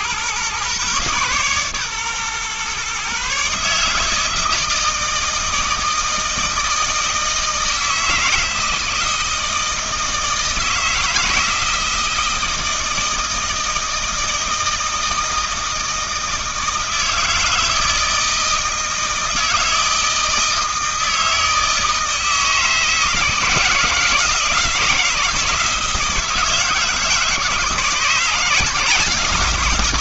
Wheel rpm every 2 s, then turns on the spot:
130, 130, 160, 160, 160, 160, 160, 160, 160, 160, 160, 160, 170, 160, 170.
none